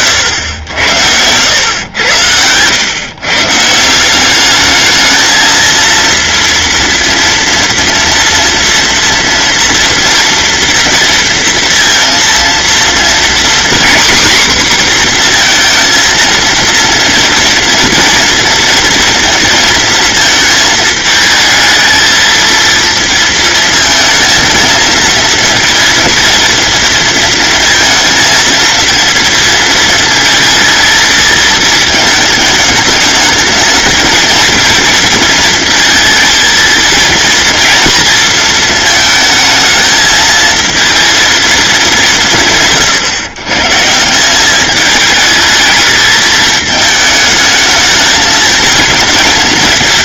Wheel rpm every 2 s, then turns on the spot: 80, 120, 220, 230, 230, 230, 240, 250, 230, 230, 220, 230, 230, 230, 230, 220, 220, 230, 230, 220, 230, 140, 210, 220, 220.
none